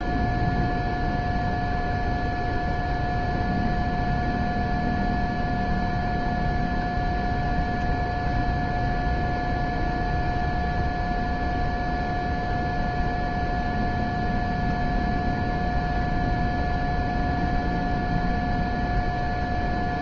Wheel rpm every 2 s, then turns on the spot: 0, 0, 0, 0, 0, 0, 0, 0, 0, 0.
none